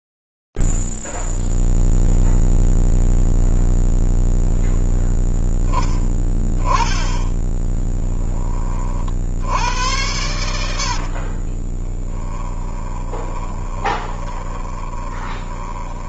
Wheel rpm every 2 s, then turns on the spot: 0, 0, 0, 10, 10, 90, 30, 20.
8-10 12-16